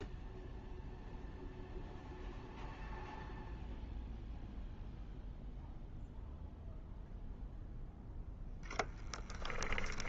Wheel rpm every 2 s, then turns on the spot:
0, 0, 0, 0, 0.
none